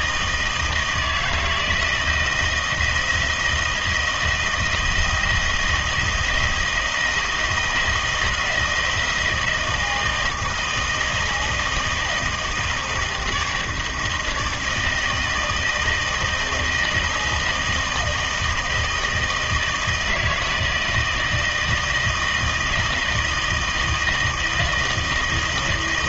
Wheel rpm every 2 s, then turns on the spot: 160, 170, 170, 170, 160, 160, 160, 160, 160, 160, 160, 160, 160.
none